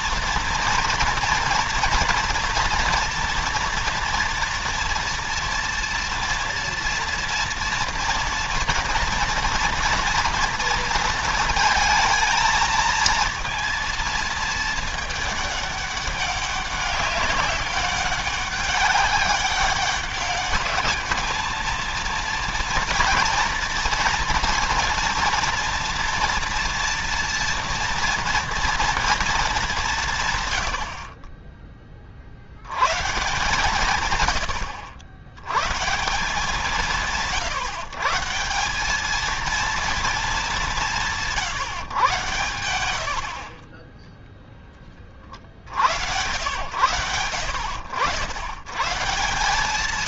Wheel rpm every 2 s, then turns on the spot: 230, 230, 230, 230, 230, 230, 220, 220, 200, 190, 210, 230, 230, 230, 230, 60, 110, 90, 160, 190, 200, 90, 20, 100, 120.
none